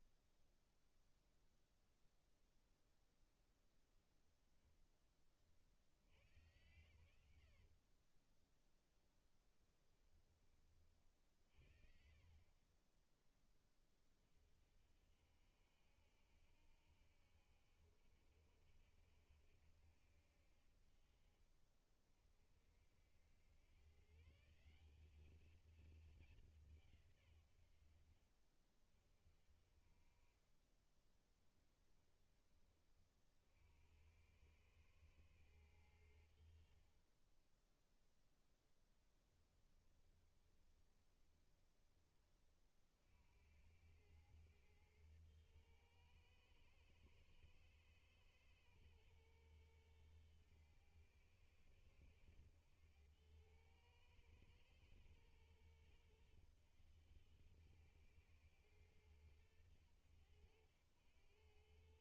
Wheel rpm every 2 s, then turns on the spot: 0, 0, 20, 110, 20, 40, 10, 60, 70, 70, 50, 70, 190, 140, 40, 10, 40, 110, 30, 10, 20, 60, 110, 110, 110, 110, 100, 110, 100, 100, 90.
20-22 30-32 38-42